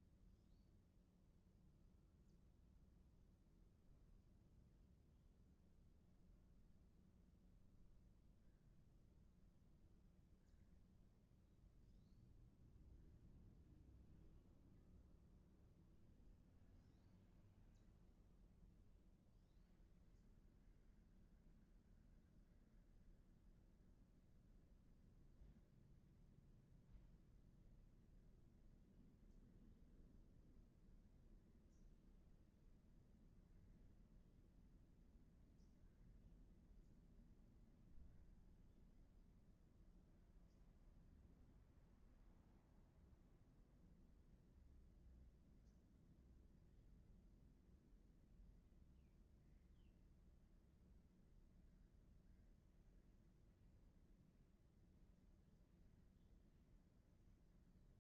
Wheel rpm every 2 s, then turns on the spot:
0, 0, 0, 0, 0, 0, 0, 0, 0, 0, 0, 0, 0, 0, 0, 0, 0, 0, 0, 0, 0, 0, 0, 0, 0, 0, 0, 0, 0.
none